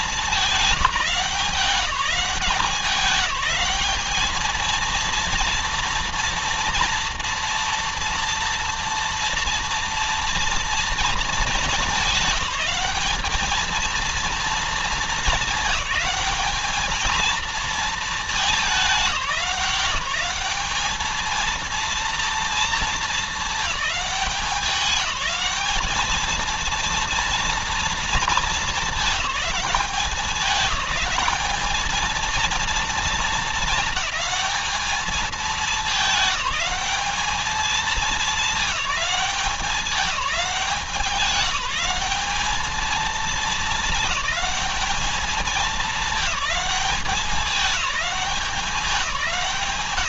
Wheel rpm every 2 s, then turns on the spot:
190, 200, 220, 230, 240, 230, 210, 230, 220, 210, 200, 230, 200, 220, 220, 210, 230, 220, 210, 210, 190, 210, 210, 210, 190.
none